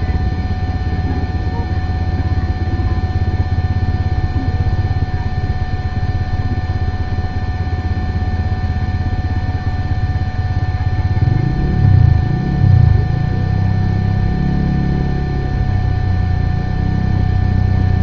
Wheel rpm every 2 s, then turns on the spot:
0, 0, 0, 0, 0, 0, 0, 0, 0.
none